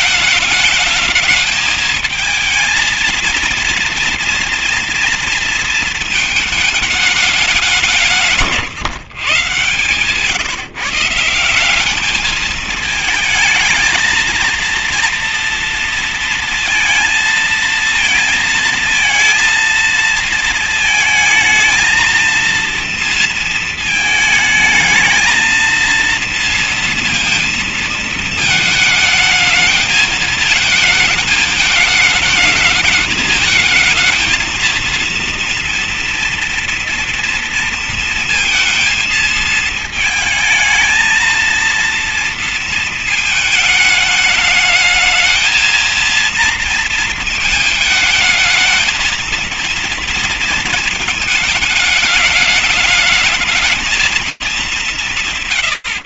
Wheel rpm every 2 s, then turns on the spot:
220, 230, 230, 170, 140, 200, 220, 230, 220, 230, 230, 230, 230, 230, 220, 210, 220, 230, 230, 220, 230, 210, 220, 220, 230, 220, 210, 150.
none